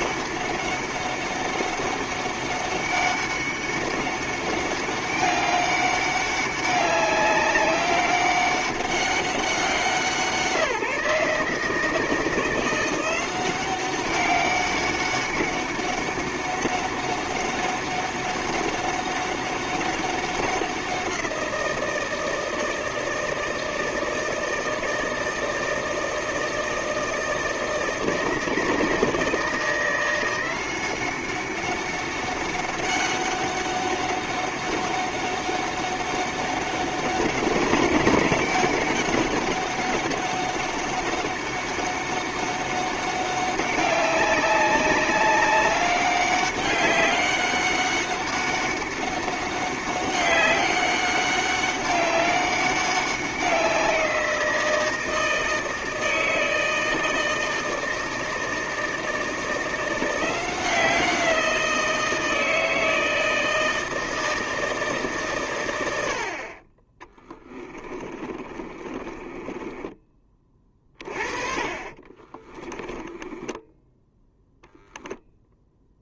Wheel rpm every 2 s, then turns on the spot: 200, 200, 200, 200, 200, 170, 180, 200, 200, 200, 180, 160, 160, 160, 160, 180, 200, 200, 190, 200, 200, 200, 200, 200, 200, 200, 190, 170, 160, 160, 180, 160, 150, 20, 30, 40, 10, 0.
68-70 72-74